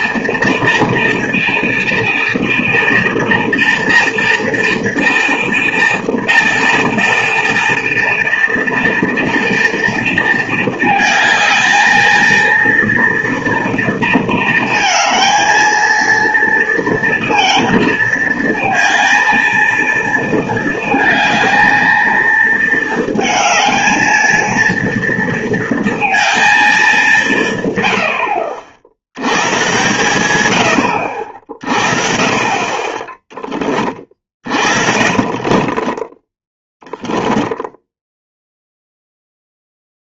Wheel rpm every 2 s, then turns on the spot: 230, 230, 230, 230, 230, 220, 230, 230, 230, 220, 230, 230, 230, 220, 70, 90, 30, 40, 10, 0.
34-38